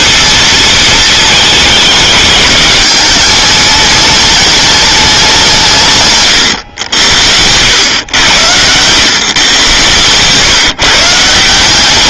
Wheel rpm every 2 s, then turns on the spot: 230, 210, 210, 120, 90, 140.
none